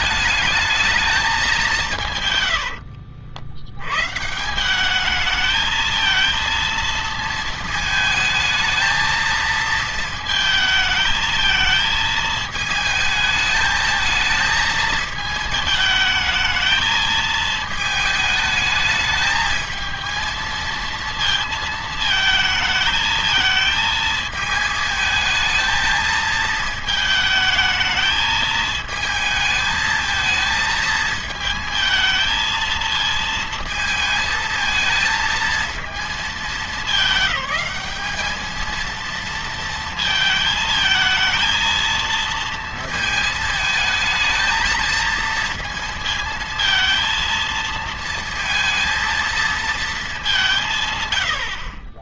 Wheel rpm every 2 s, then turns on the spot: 210, 100, 170, 230, 220, 220, 220, 220, 220, 210, 230, 220, 220, 220, 220, 220, 230, 220, 220, 220, 220, 230, 220, 230, 230, 170.
2-4